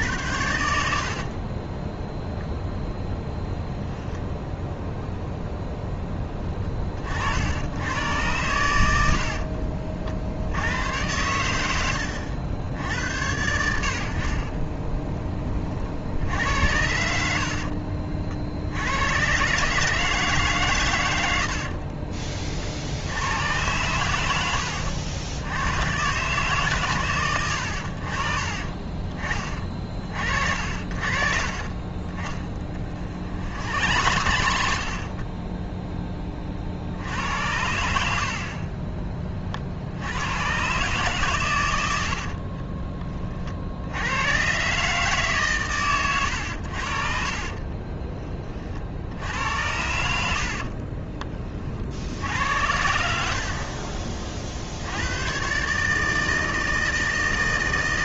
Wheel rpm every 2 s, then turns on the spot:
70, 0, 0, 30, 80, 90, 90, 20, 80, 90, 130, 60, 80, 130, 30, 50, 30, 70, 60, 20, 120, 30, 130, 70, 50, 40, 80, 70, 160.
32-34 42-44 50-54